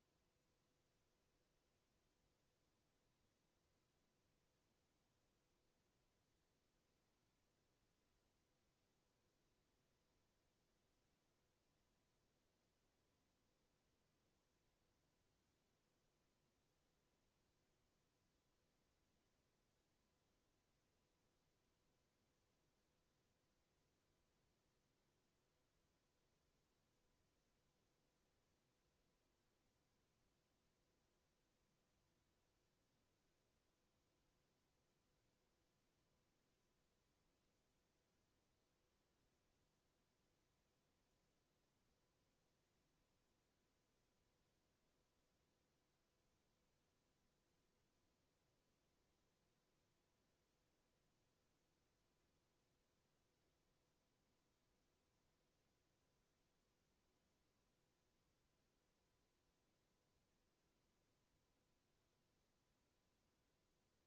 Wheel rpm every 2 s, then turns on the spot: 0, 0, 0, 0, 0, 0, 0, 0, 0, 0, 0, 0, 0, 0, 0, 0, 0, 0, 0, 0, 0, 0, 0, 0, 0, 0, 0, 0, 0, 0, 0, 0.
none